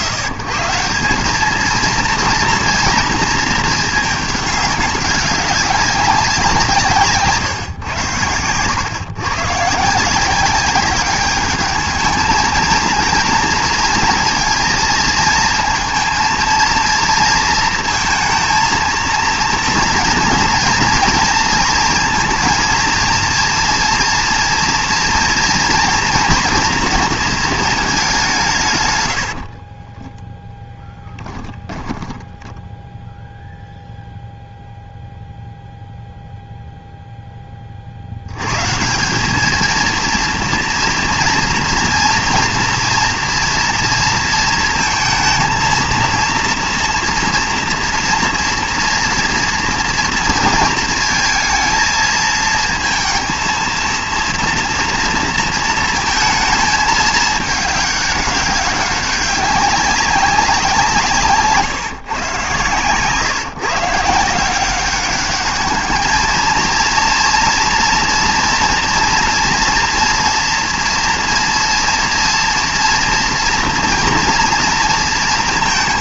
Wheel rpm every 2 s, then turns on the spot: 120, 230, 200, 170, 120, 190, 220, 230, 230, 230, 230, 230, 230, 230, 130, 10, 10, 0, 0, 130, 230, 230, 230, 230, 240, 230, 230, 230, 220, 200, 190, 140, 180, 230, 230, 240, 240, 230.
30-34